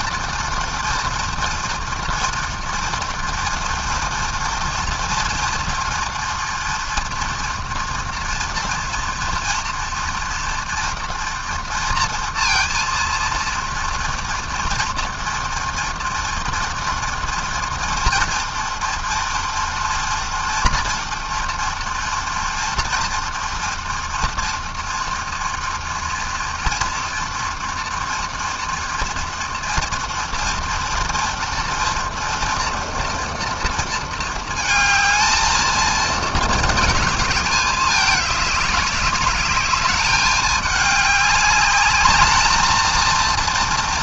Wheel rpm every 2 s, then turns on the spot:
230, 230, 240, 230, 230, 230, 230, 230, 230, 230, 230, 230, 230, 230, 230, 230, 230, 220, 210, 210, 200, 230.
none